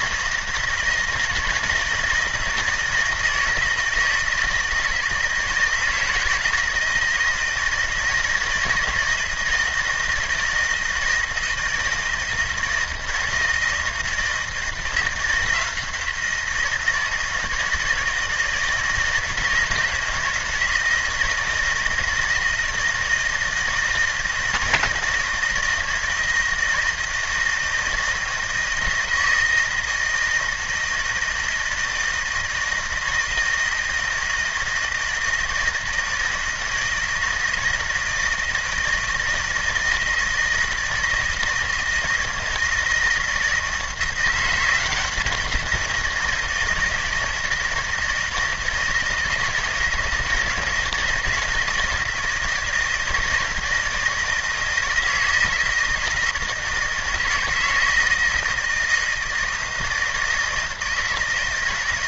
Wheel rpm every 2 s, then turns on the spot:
160, 160, 160, 160, 160, 160, 160, 170, 160, 160, 160, 160, 160, 160, 160, 160, 160, 160, 160, 160, 160, 160, 180, 160, 160, 160, 160, 160, 160, 160, 160.
none